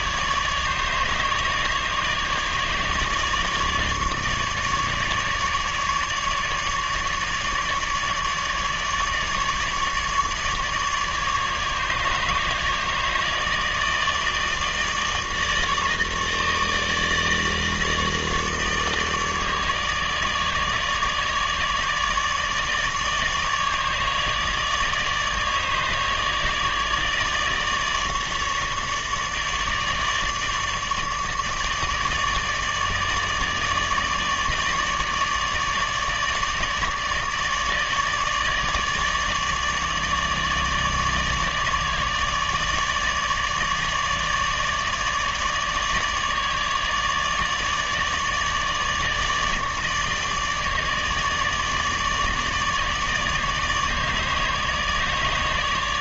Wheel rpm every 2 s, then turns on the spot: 150, 150, 150, 150, 150, 150, 150, 160, 150, 160, 150, 150, 150, 150, 150, 150, 150, 150, 150, 150, 150, 150, 150, 150, 150, 150, 150, 150.
none